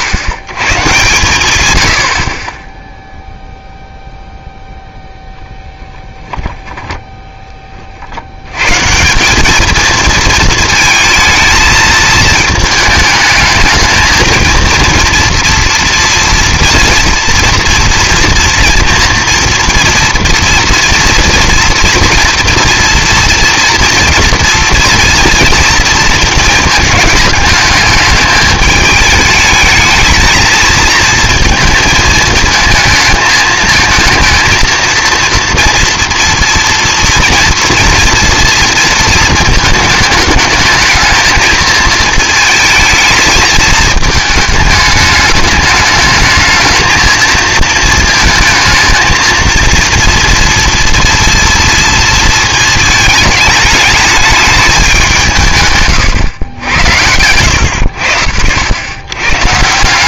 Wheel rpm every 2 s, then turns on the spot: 120, 0, 0, 0, 130, 220, 220, 230, 240, 230, 230, 230, 230, 220, 210, 220, 230, 230, 240, 230, 220, 220, 210, 220, 220, 230, 230, 200, 80, 80.
56-58